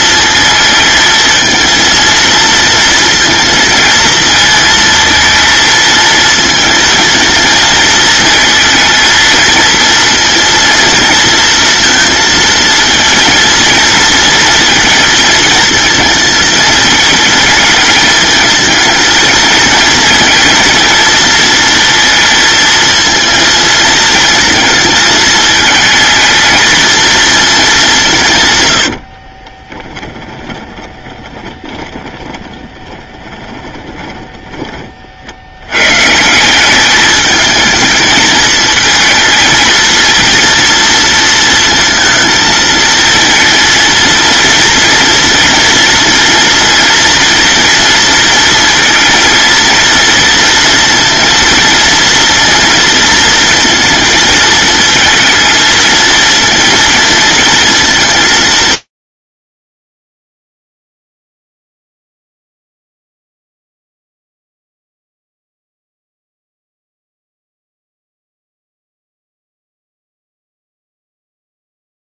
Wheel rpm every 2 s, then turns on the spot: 230, 230, 230, 220, 230, 230, 230, 220, 220, 230, 230, 230, 220, 230, 70, 30, 20, 30, 200, 220, 230, 230, 240, 230, 230, 230, 230, 220, 230, 110, 0, 0, 0, 0, 0, 0.
28-34